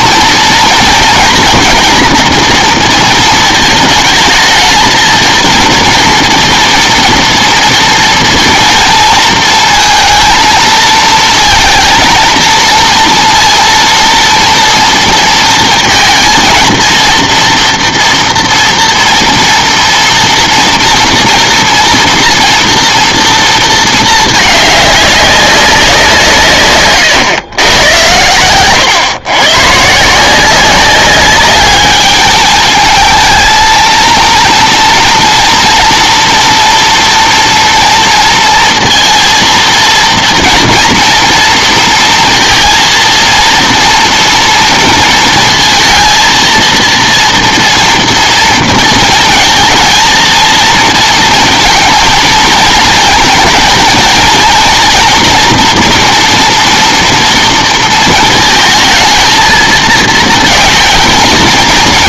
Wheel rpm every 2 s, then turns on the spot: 230, 230, 230, 230, 230, 230, 230, 230, 230, 230, 230, 230, 200, 120, 110, 190, 220, 230, 230, 230, 230, 230, 230, 230, 230, 230, 230, 240, 230, 220, 230.
none